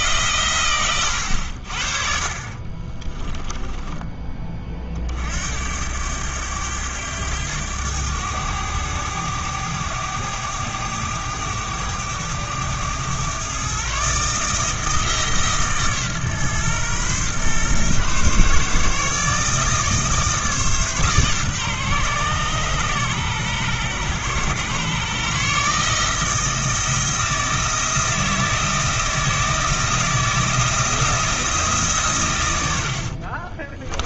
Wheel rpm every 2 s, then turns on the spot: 110, 30, 40, 100, 100, 100, 110, 160, 130, 150, 150, 130, 130, 160, 160, 160, 90.
2-4 32-34